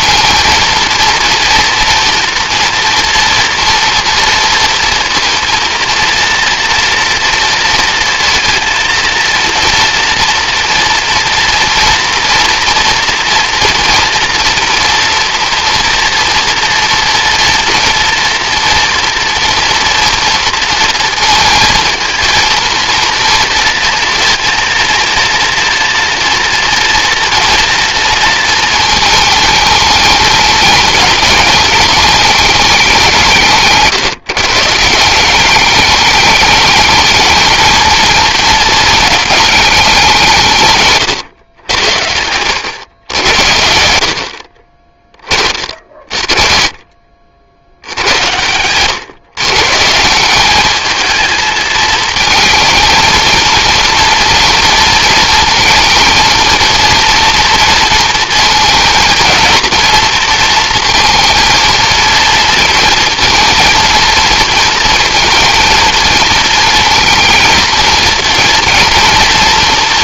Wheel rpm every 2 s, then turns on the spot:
230, 230, 230, 230, 230, 230, 240, 230, 230, 230, 230, 230, 230, 230, 220, 210, 210, 150, 210, 230, 140, 100, 40, 40, 110, 210, 220, 230, 220, 230, 230, 230, 230, 220, 230.
none